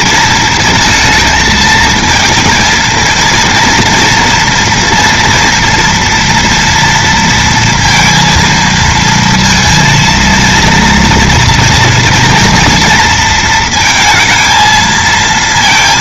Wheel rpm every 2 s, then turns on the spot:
220, 230, 230, 230, 230, 230, 230, 220.
none